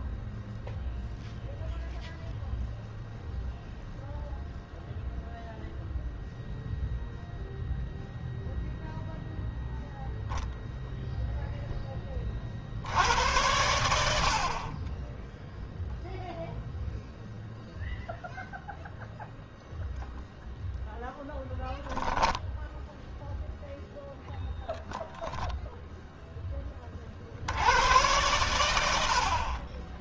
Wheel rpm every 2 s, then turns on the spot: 0, 0, 0, 0, 0, 60, 40, 0, 0, 0, 0, 0, 30, 90, 70.
none